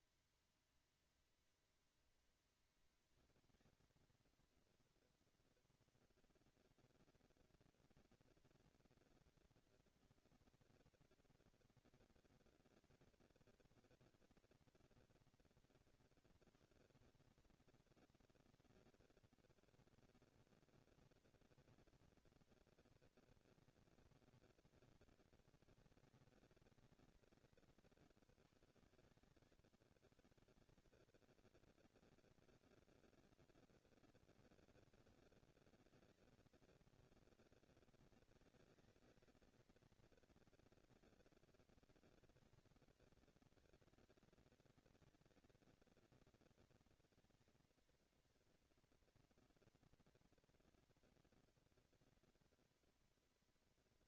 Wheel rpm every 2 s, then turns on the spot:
240, 230, 230, 230, 230, 230, 230, 230, 160, 190, 210, 230, 230, 200, 140, 140, 230, 230, 220, 210, 230, 230, 230, 230, 230, 240, 230.
none